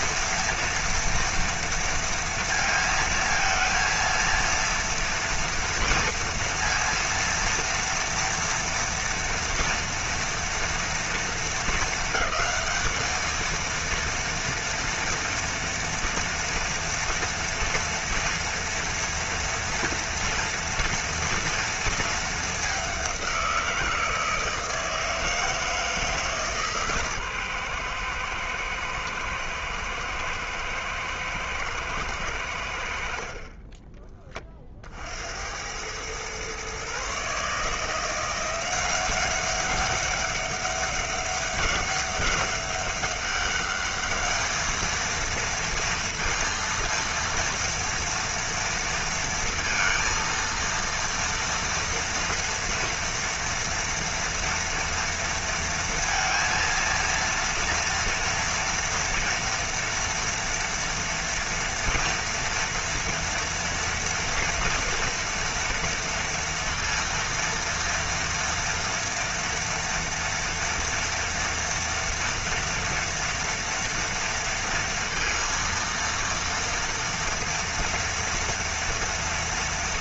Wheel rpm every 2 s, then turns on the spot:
230, 230, 230, 230, 230, 240, 200, 230, 240, 230, 230, 210, 160, 150, 120, 110, 90, 30, 120, 180, 200, 200, 210, 230, 230, 230, 230, 230, 230, 240, 240, 230, 230, 230, 230, 230, 230, 230, 230, 230.
none